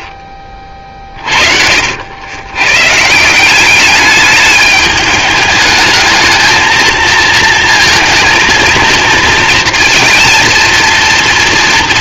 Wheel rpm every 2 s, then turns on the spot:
40, 130, 210, 220, 230, 230.
none